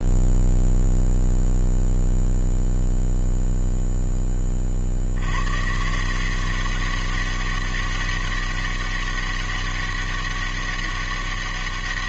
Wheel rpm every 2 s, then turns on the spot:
0, 0, 60, 190, 200, 200.
none